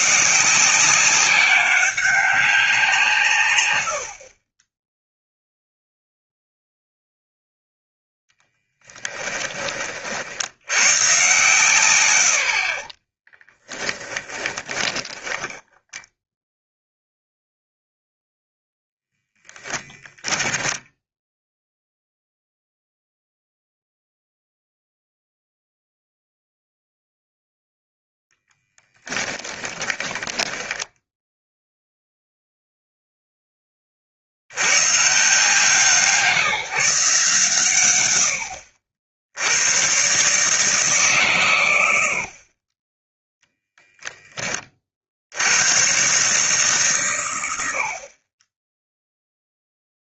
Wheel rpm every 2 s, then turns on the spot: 180, 180, 10, 0, 10, 110, 40, 20, 10, 0, 10, 0, 0, 0, 10, 10, 0, 110, 150, 60, 150, 30, 30, 140, 10.
8-10 14-16 20-22 28-32